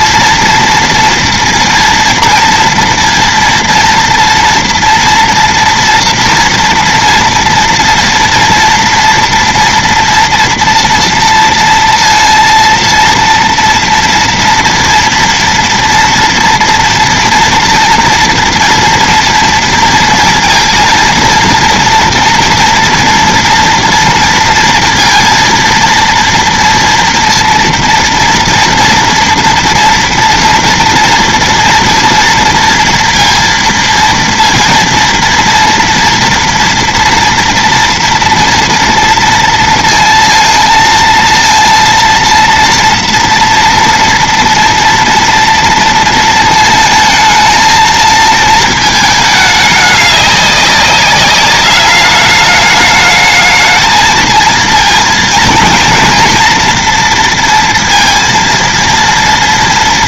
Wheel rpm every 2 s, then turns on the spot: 230, 230, 230, 230, 240, 230, 230, 240, 230, 230, 230, 230, 230, 230, 230, 230, 230, 230, 230, 230, 230, 230, 230, 230, 220, 200, 210, 230, 230, 230.
none